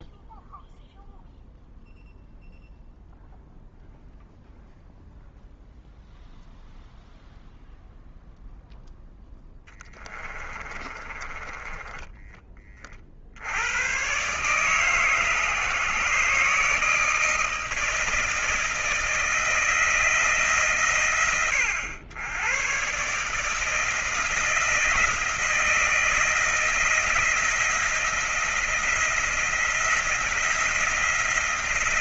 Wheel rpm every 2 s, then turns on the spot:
0, 0, 0, 0, 0, 20, 20, 130, 150, 160, 130, 110, 160, 170, 170, 160.
10-12